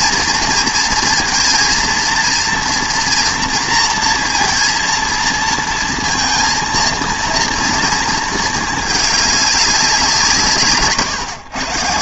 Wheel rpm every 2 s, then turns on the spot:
230, 230, 230, 230, 220, 150.
none